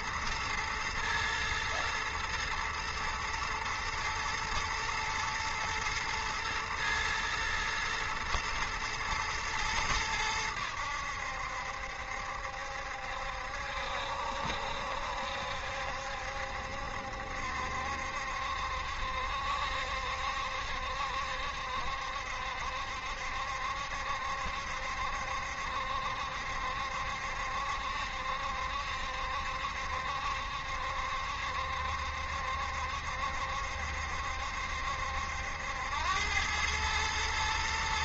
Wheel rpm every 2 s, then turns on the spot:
120, 110, 120, 120, 120, 80, 70, 70, 70, 70, 70, 70, 70, 70, 70, 70, 70, 70, 110.
none